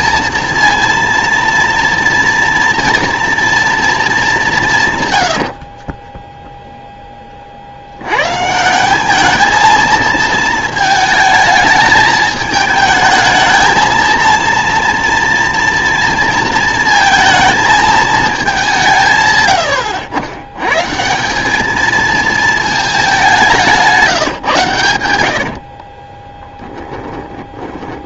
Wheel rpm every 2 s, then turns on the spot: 230, 230, 170, 10, 160, 220, 220, 230, 220, 180, 130, 220, 120, 10.
26-28